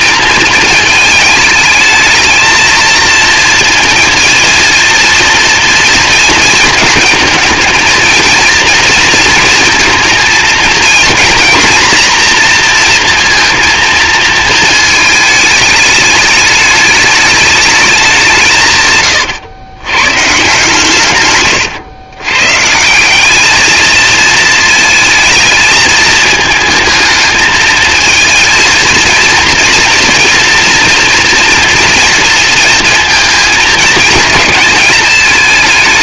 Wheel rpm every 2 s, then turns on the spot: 220, 230, 230, 220, 230, 230, 240, 220, 210, 150, 140, 160, 230, 220, 220, 230, 230, 220.
none